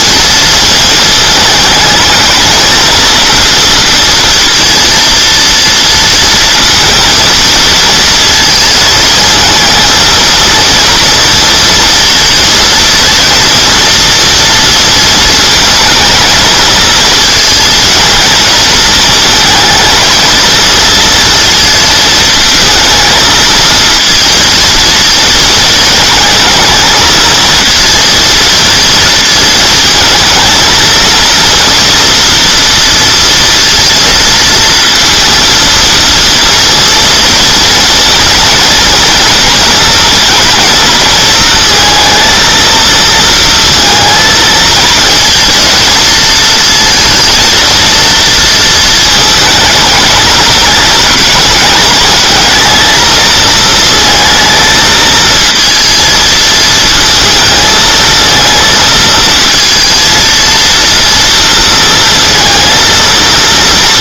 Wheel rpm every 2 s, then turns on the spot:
220, 230, 230, 230, 220, 230, 230, 230, 220, 220, 230, 230, 230, 220, 230, 230, 230, 230, 230, 230, 230, 230, 220, 230, 220, 210, 220, 220, 220, 230, 230, 230.
none